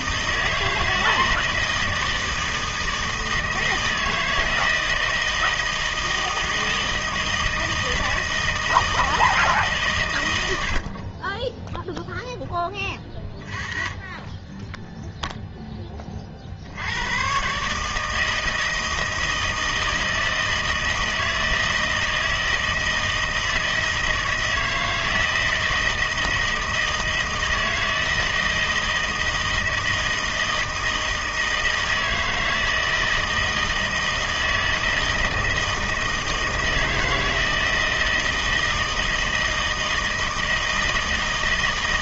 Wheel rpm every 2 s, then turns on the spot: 160, 160, 160, 160, 160, 80, 10, 10, 70, 160, 160, 160, 160, 160, 160, 160, 160, 160, 160, 160, 160.
none